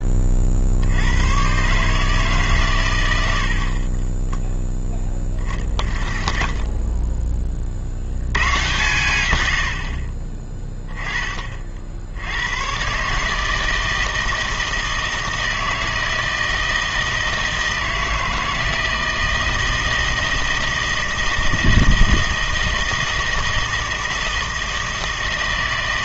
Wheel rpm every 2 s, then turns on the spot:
60, 110, 0, 0, 130, 20, 120, 160, 160, 160, 160, 160, 160.
none